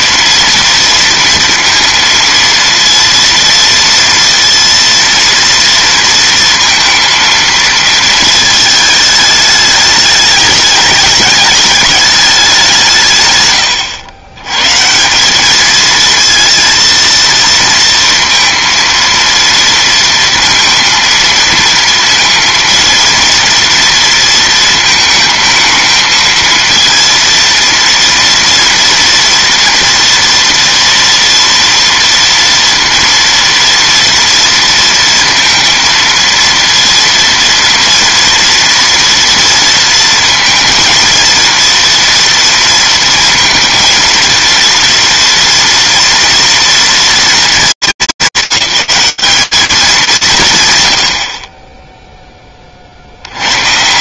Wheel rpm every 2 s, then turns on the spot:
230, 230, 230, 230, 220, 210, 190, 130, 230, 230, 230, 230, 230, 230, 230, 230, 230, 230, 230, 240, 230, 230, 230, 230, 190, 150, 30.
none